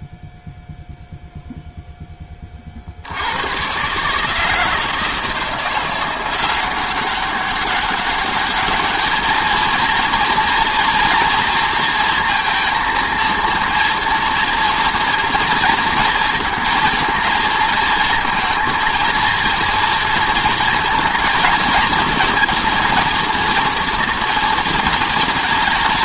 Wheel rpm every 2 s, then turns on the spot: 0, 30, 160, 180, 210, 240, 230, 230, 230, 220, 230, 230, 220.
none